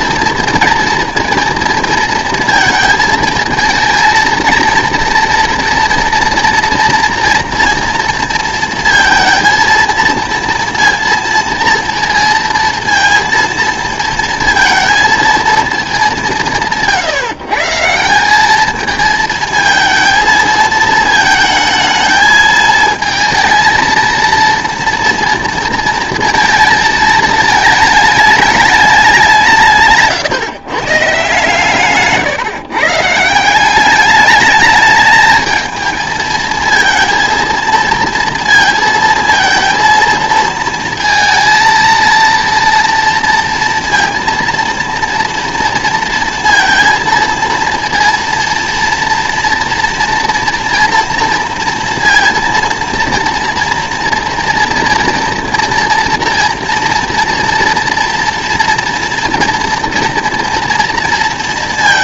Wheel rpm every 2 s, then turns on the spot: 230, 230, 230, 240, 230, 230, 230, 230, 160, 210, 220, 220, 230, 220, 210, 140, 140, 210, 230, 230, 230, 230, 230, 230, 230, 230, 230, 230, 230, 230, 230.
none